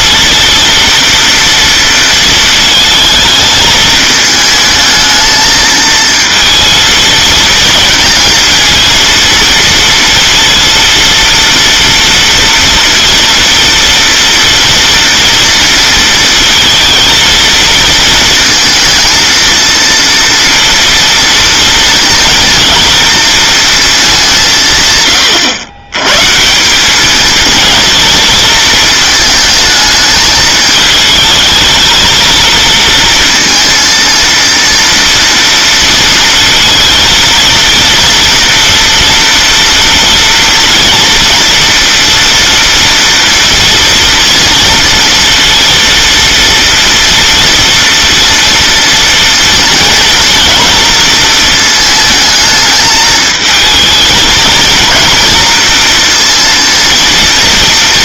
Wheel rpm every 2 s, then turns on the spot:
230, 230, 220, 230, 220, 230, 230, 230, 230, 230, 230, 230, 170, 160, 220, 210, 230, 230, 230, 230, 230, 240, 230, 230, 230, 230, 220, 230, 230.
none